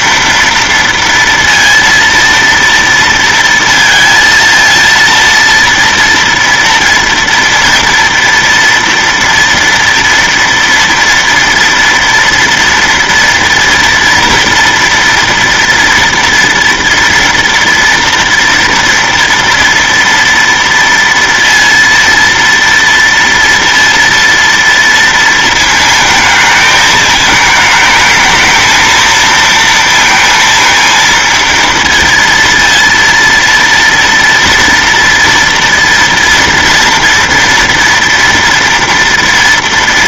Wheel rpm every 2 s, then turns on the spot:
230, 230, 230, 230, 230, 230, 230, 230, 230, 240, 230, 230, 230, 220, 220, 230, 230, 230, 230, 230.
none